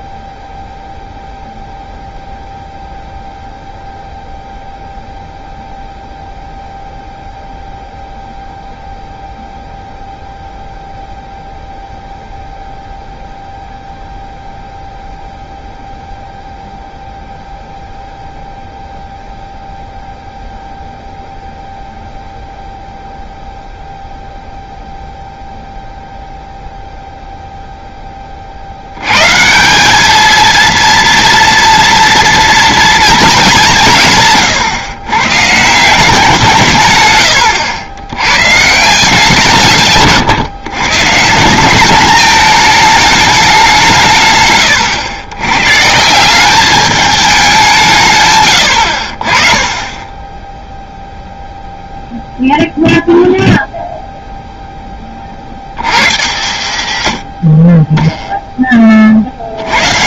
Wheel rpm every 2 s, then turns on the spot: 0, 0, 0, 0, 0, 0, 0, 0, 0, 0, 0, 0, 0, 0, 50, 220, 230, 130, 160, 140, 120, 210, 120, 190, 100, 0, 0, 0, 110, 10.
none